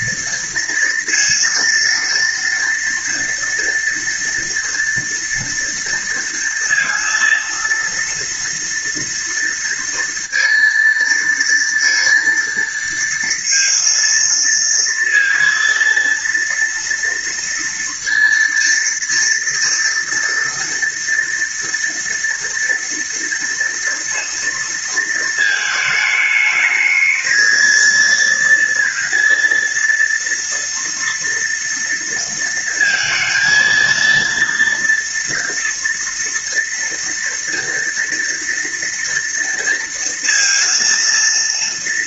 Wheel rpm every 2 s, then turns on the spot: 230, 230, 230, 230, 230, 230, 230, 230, 230, 230, 230, 240, 230, 220, 230, 230, 230, 230, 230, 230, 230.
none